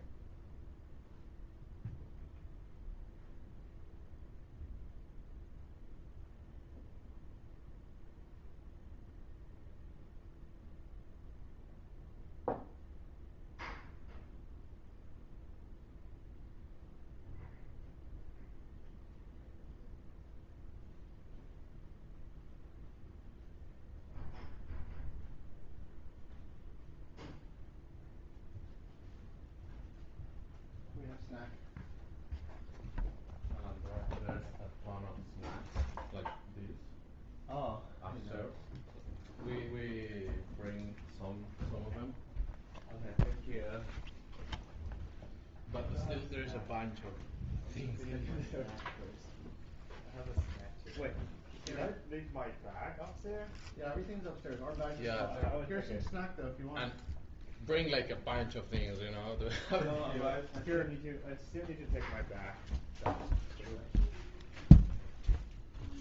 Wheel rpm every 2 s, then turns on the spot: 0, 0, 0, 0, 0, 0, 0, 0, 0, 0, 0, 0, 0, 0, 0, 0, 0, 0, 0, 0, 0, 0, 0, 0, 0, 0, 0, 0, 0, 0, 0, 0, 0.
none